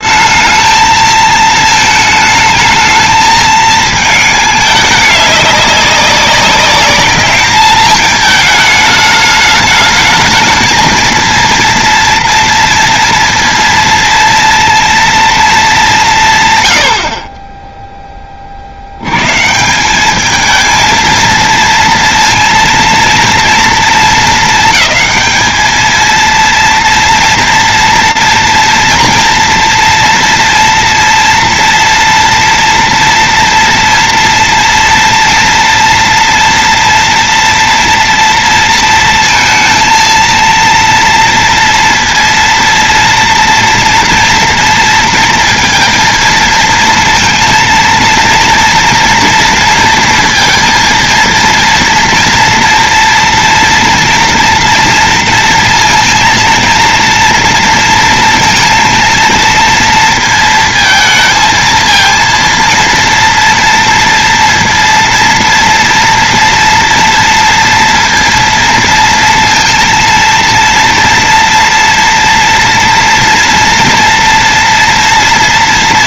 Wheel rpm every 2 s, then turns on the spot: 220, 220, 210, 200, 220, 220, 230, 230, 90, 70, 230, 230, 210, 230, 230, 230, 230, 230, 240, 230, 230, 230, 230, 230, 230, 230, 230, 230, 230, 230, 230, 230, 230, 230, 230, 230, 240, 240.
none